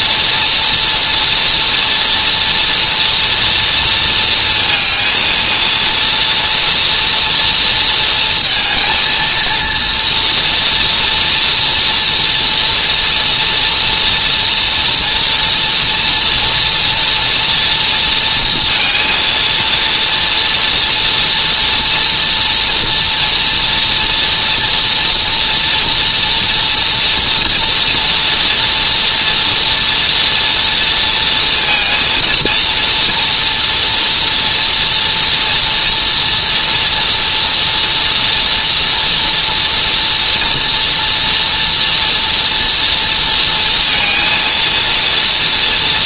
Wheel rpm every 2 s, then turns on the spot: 240, 240, 220, 230, 230, 230, 240, 230, 230, 230, 230, 230, 230, 240, 240, 230, 230, 230, 230, 230, 240, 230, 230.
none